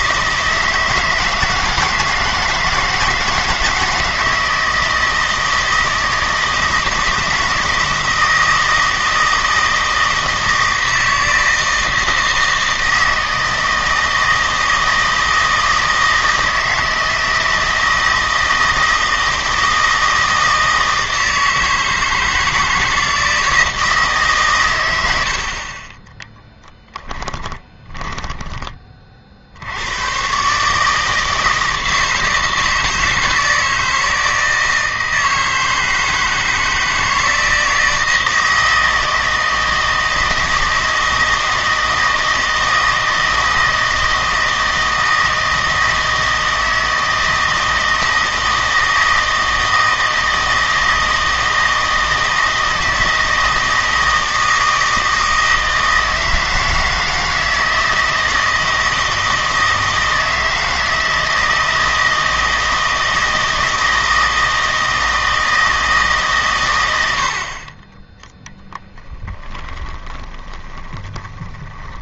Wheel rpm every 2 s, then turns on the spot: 160, 160, 160, 160, 160, 160, 160, 160, 160, 160, 160, 160, 110, 10, 20, 150, 160, 160, 160, 160, 160, 160, 160, 160, 160, 160, 160, 160, 160, 160, 160, 160, 160, 110, 10, 20.
26-28 68-72